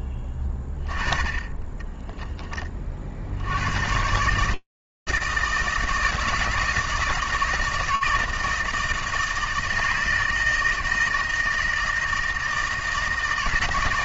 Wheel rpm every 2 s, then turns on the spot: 20, 60, 160, 160, 160, 160, 160.
none